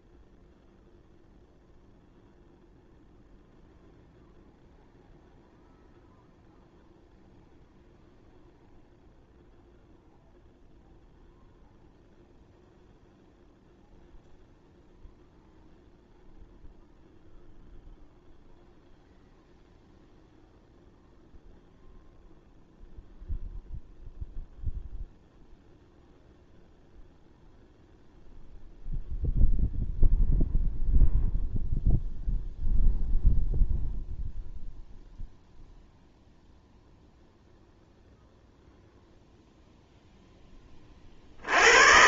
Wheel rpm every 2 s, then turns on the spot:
0, 0, 0, 0, 0, 0, 0, 0, 0, 0, 0, 0, 0, 0, 0, 0, 0, 0, 0, 0, 60.
none